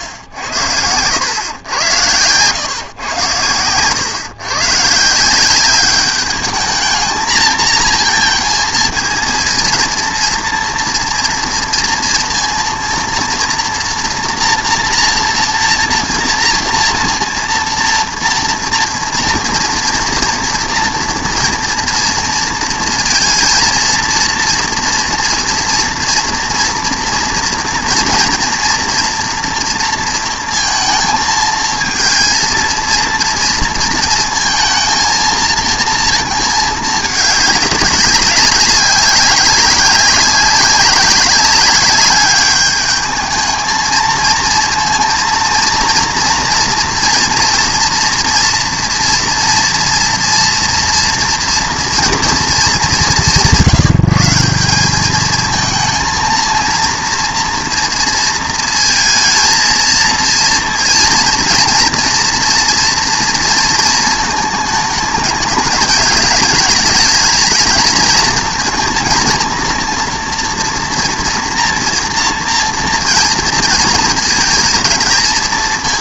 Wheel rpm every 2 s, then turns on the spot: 100, 120, 140, 220, 230, 230, 230, 230, 230, 230, 230, 230, 230, 230, 230, 220, 230, 230, 220, 200, 190, 210, 230, 230, 240, 240, 200, 190, 230, 230, 230, 230, 210, 210, 230, 230, 230, 220.
0-2